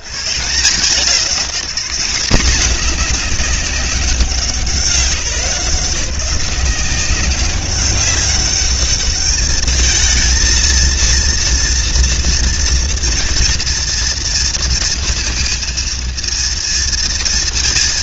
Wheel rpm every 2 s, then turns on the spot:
100, 210, 180, 180, 200, 230, 230, 230, 230.
none